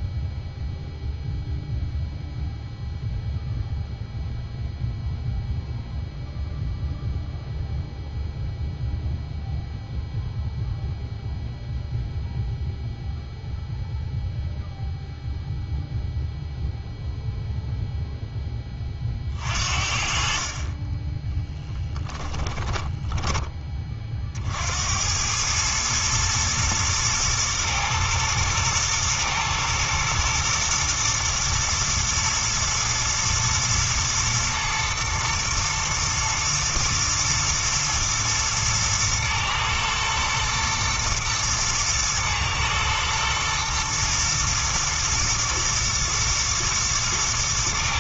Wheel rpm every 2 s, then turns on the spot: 0, 0, 0, 0, 0, 0, 0, 0, 0, 30, 20, 20, 80, 120, 110, 120, 110, 110, 110, 110, 120, 120, 120, 120.
22-24